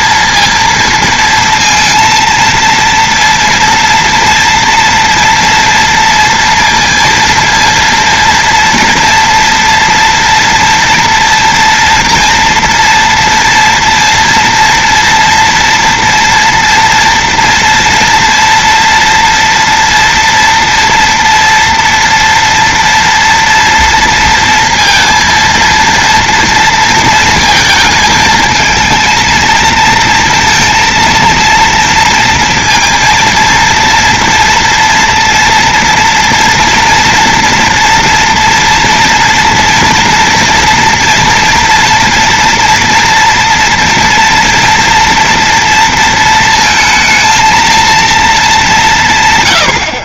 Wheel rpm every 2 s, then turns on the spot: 230, 230, 230, 230, 230, 230, 230, 230, 230, 240, 230, 230, 230, 230, 220, 230, 230, 230, 230, 230, 230, 240, 230, 230, 220.
none